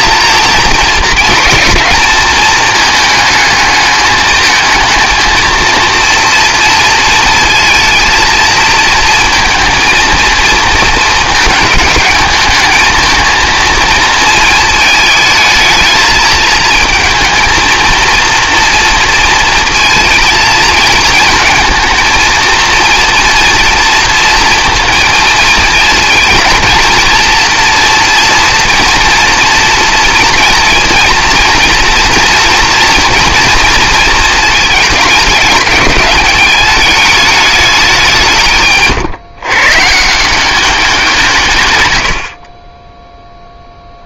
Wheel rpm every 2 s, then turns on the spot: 230, 220, 220, 230, 230, 230, 220, 220, 220, 230, 230, 230, 230, 230, 230, 230, 230, 220, 210, 150, 190, 30.
none